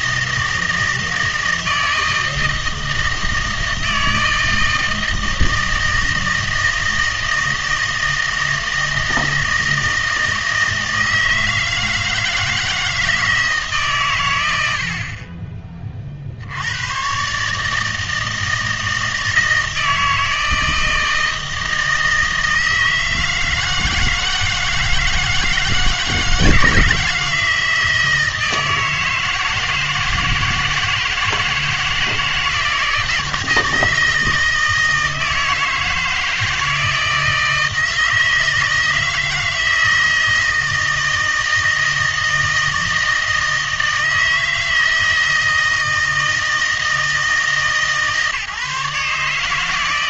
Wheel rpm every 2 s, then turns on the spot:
160, 160, 160, 160, 160, 160, 160, 90, 90, 160, 160, 160, 160, 160, 160, 160, 160, 160, 160, 160, 160, 160, 160, 160, 150.
none